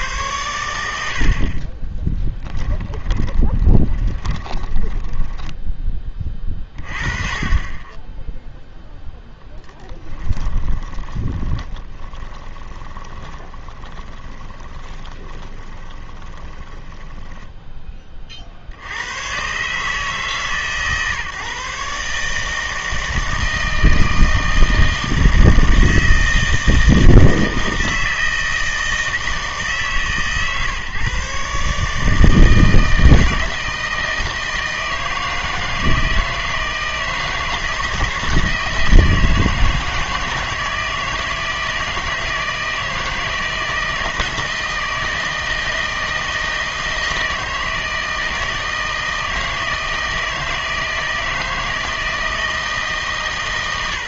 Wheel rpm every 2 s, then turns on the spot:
100, 10, 10, 30, 0, 20, 20, 20, 10, 70, 150, 160, 160, 160, 160, 140, 160, 160, 160, 160, 160, 160, 160, 160, 160, 160, 150.
2-6 10-18